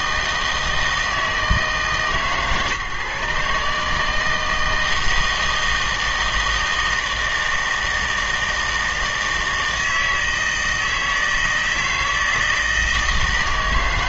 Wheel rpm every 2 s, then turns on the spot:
160, 150, 160, 160, 160, 160, 160.
none